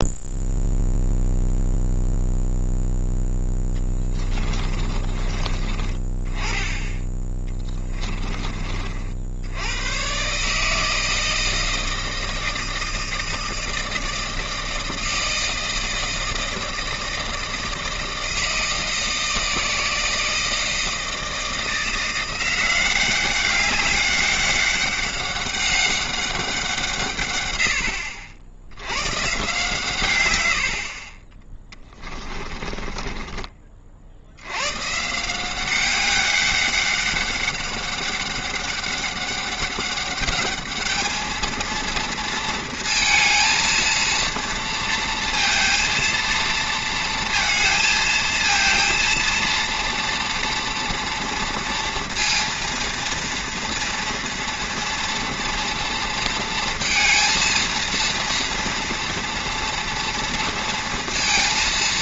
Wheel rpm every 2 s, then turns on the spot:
0, 0, 20, 20, 30, 150, 160, 160, 160, 160, 160, 180, 200, 180, 80, 80, 20, 110, 200, 200, 210, 230, 230, 230, 230, 230, 230, 230, 230, 230, 230.
4-6 32-34